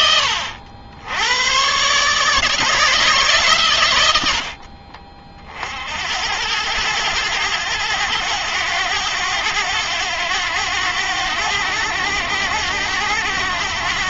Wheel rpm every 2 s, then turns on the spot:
90, 150, 50, 100, 100, 90, 90.
none